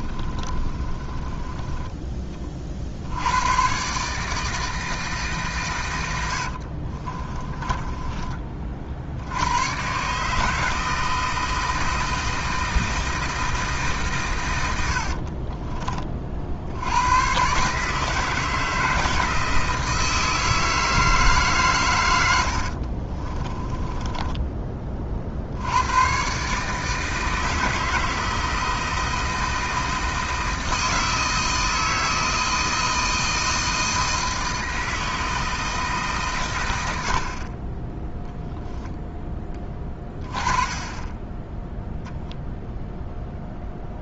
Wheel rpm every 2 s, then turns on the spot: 30, 50, 160, 50, 30, 160, 160, 90, 80, 160, 160, 60, 20, 150, 160, 160, 160, 160, 90, 0, 20, 0.
0-2 6-8 14-16 22-24